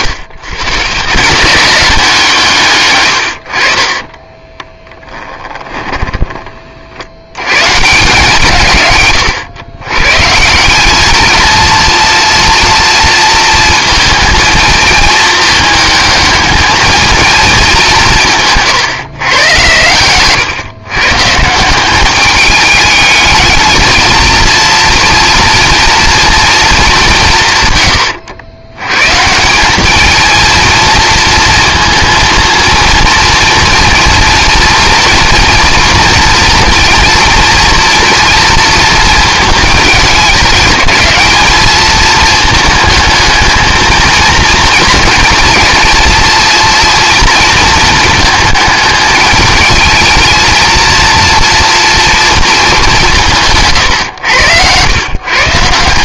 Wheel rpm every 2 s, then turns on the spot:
140, 140, 10, 40, 140, 200, 230, 220, 220, 150, 140, 210, 230, 210, 110, 230, 230, 230, 240, 230, 210, 220, 230, 230, 210, 230, 230, 110.
2-6